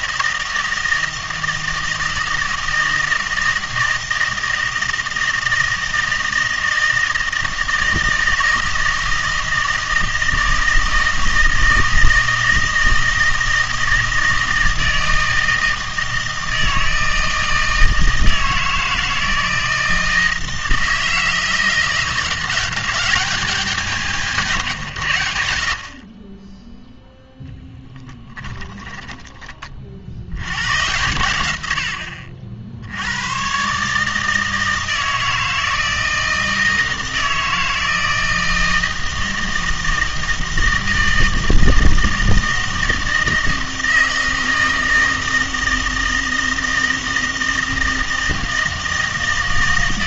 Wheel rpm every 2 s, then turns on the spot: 160, 160, 160, 160, 160, 160, 160, 160, 160, 160, 160, 180, 130, 10, 10, 100, 70, 160, 160, 160, 160, 160, 160, 160, 160.
none